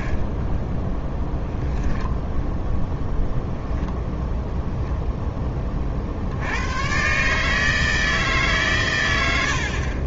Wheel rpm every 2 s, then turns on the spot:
10, 0, 0, 110, 120.
none